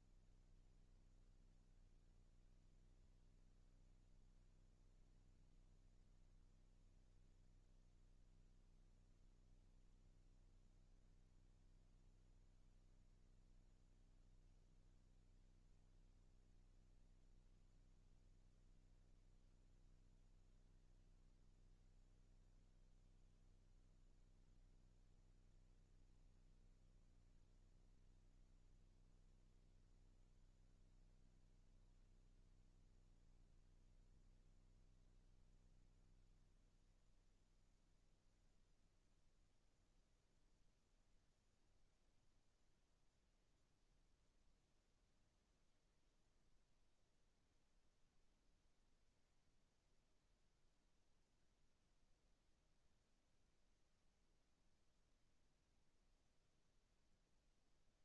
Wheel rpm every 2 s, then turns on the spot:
0, 0, 0, 0, 0, 0, 0, 0, 0, 0, 0, 0, 0, 0, 0, 0, 0, 0, 0, 0, 0, 0, 0, 0, 0, 0, 0, 0, 0.
none